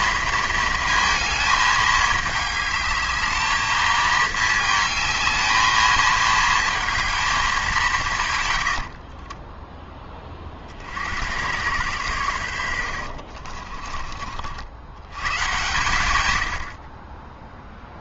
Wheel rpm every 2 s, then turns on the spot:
230, 220, 220, 220, 70, 70, 80, 70, 70.
8-10 12-14